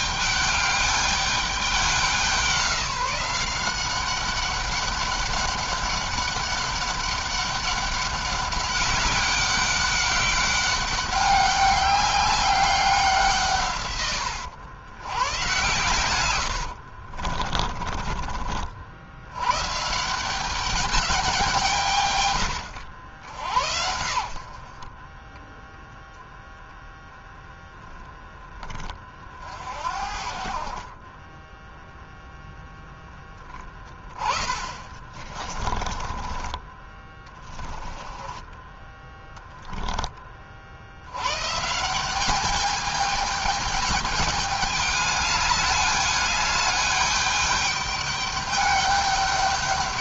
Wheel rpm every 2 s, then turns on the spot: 210, 180, 190, 200, 190, 190, 190, 110, 70, 60, 200, 80, 40, 0, 30, 40, 0, 20, 20, 10, 70, 210, 210, 210, 200.
16-18 24-26 30-32 34-36